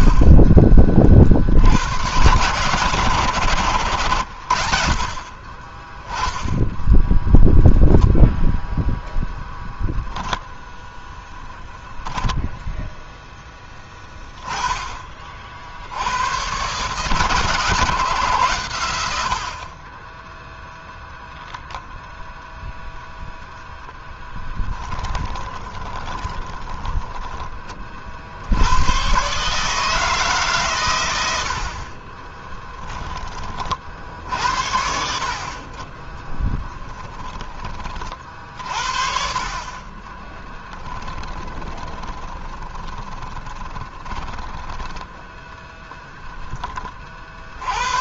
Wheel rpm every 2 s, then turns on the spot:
30, 110, 40, 0, 0, 0, 0, 30, 130, 90, 10, 0, 20, 10, 110, 120, 10, 70, 10, 50, 20, 20, 10, 20.
24-28 32-34 36-38 40-44